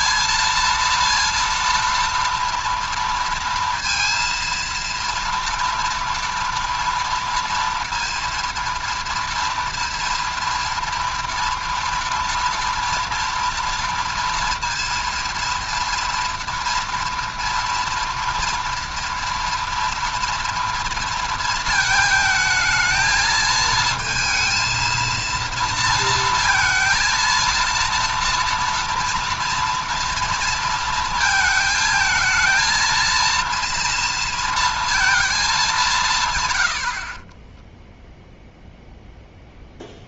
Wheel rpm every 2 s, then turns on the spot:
230, 230, 230, 230, 230, 230, 230, 230, 230, 230, 230, 220, 230, 230, 230, 230, 230, 230, 90, 0.
none